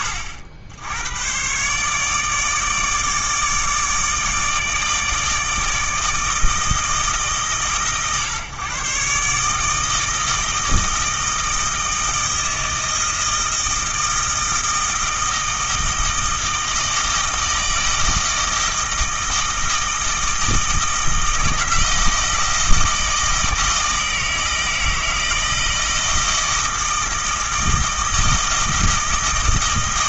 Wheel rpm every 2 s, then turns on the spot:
90, 160, 160, 160, 130, 160, 160, 160, 160, 160, 160, 160, 160, 160, 160.
none